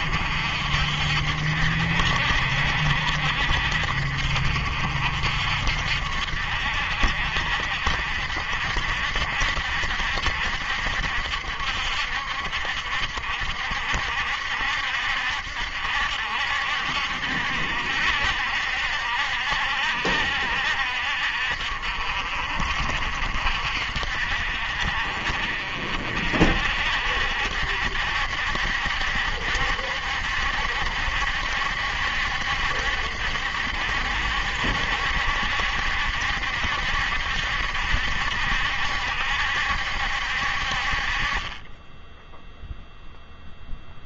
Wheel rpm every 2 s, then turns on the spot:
60, 60, 60, 60, 60, 60, 70, 70, 70, 70, 60, 60, 50, 60, 70, 70, 70, 70, 70, 70, 50, 0.
none